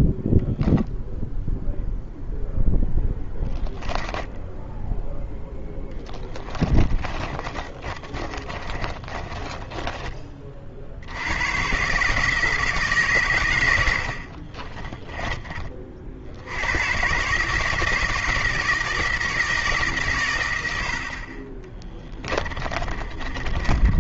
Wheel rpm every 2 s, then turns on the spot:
0, 0, 0, 20, 30, 50, 160, 30, 100, 160, 90, 30.
6-10 14-16 22-24